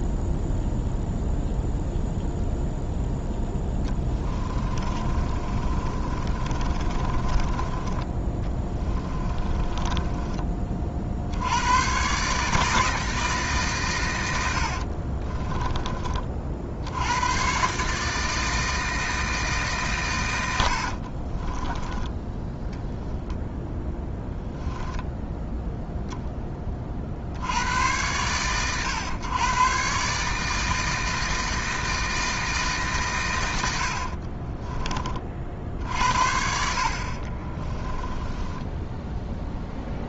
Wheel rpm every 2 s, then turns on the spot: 0, 0, 30, 30, 20, 40, 160, 50, 70, 160, 70, 0, 0, 20, 110, 160, 140, 30, 60, 10.
4-10 14-16 20-22 38-40